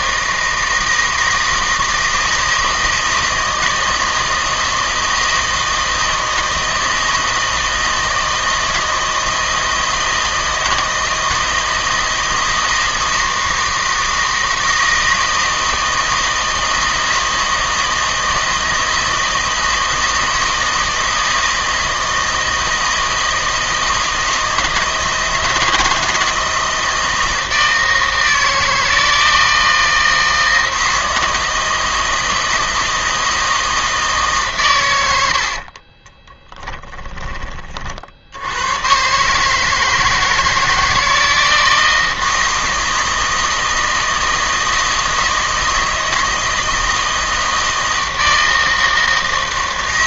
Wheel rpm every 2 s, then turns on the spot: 160, 160, 160, 160, 160, 160, 160, 160, 160, 160, 160, 160, 160, 160, 160, 160, 160, 130, 10, 100, 160, 160, 160, 160, 160.
36-38